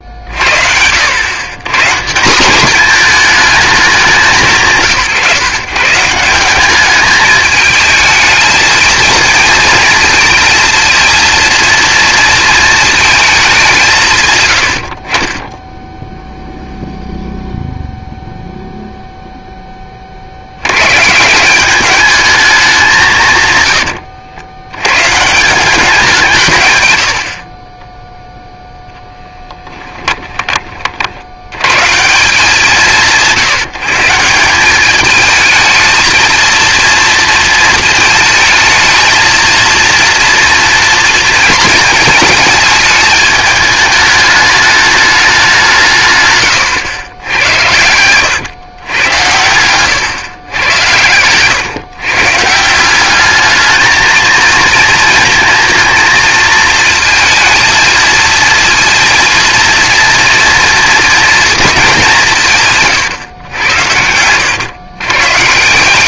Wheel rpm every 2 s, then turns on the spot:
80, 220, 150, 210, 230, 230, 230, 60, 0, 0, 130, 190, 110, 100, 0, 50, 170, 200, 230, 220, 230, 210, 210, 100, 100, 110, 180, 230, 230, 230, 240, 130, 110.
26-28